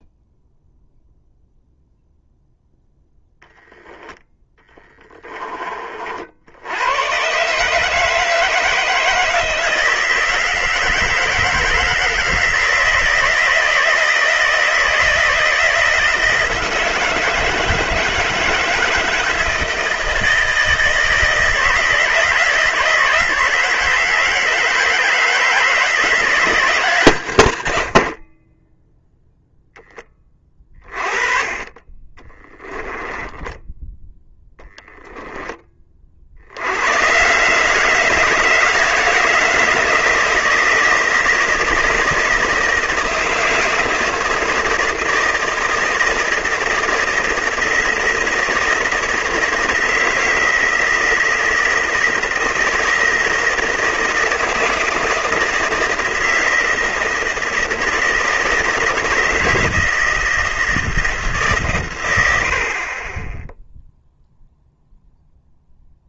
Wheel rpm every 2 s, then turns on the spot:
0, 0, 10, 100, 160, 160, 170, 160, 160, 160, 160, 160, 160, 160, 10, 30, 20, 0, 120, 180, 170, 160, 160, 160, 160, 160, 160, 160, 160, 160, 160, 50, 0.
32-34